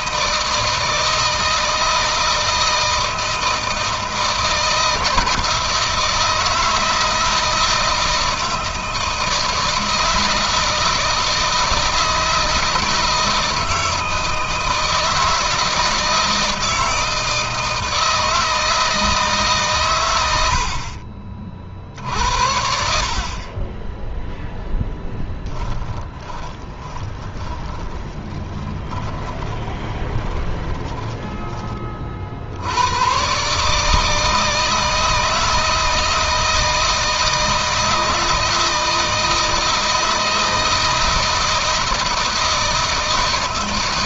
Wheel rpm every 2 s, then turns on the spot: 160, 160, 160, 160, 160, 160, 160, 160, 160, 160, 60, 60, 0, 20, 20, 20, 90, 160, 160, 160, 160, 160.
26-32